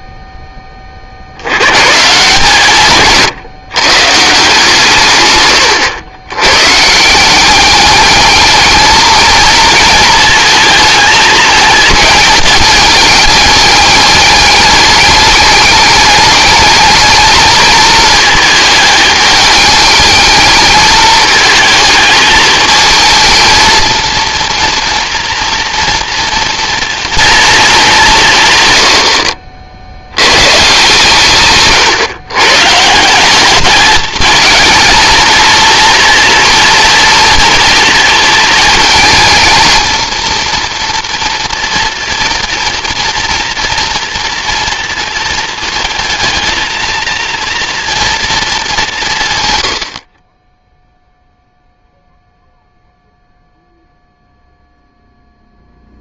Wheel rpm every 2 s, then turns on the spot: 20, 160, 150, 130, 220, 220, 210, 210, 210, 220, 220, 220, 230, 230, 120, 150, 150, 220, 230, 220, 230, 240, 230, 230, 200, 10, 0, 0.
none